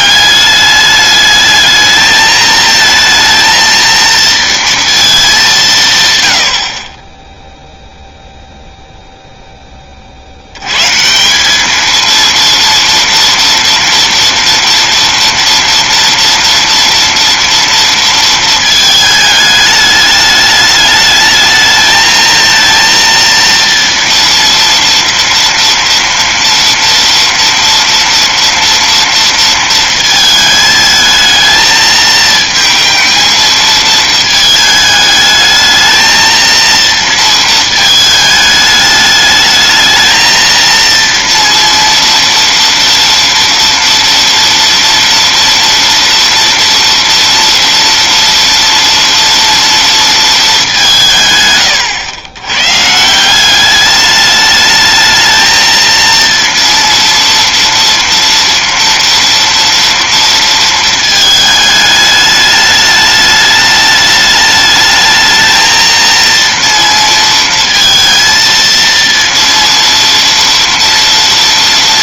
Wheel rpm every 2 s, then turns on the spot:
200, 220, 230, 50, 0, 170, 230, 230, 230, 220, 210, 230, 230, 230, 230, 220, 220, 220, 230, 210, 230, 230, 230, 230, 230, 160, 180, 220, 230, 230, 220, 210, 220, 230, 230, 230.
none